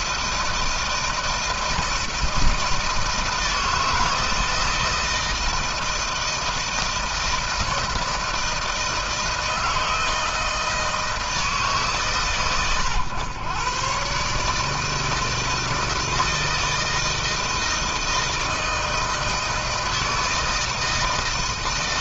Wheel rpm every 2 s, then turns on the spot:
160, 160, 160, 160, 160, 160, 110, 160, 160, 160, 160.
none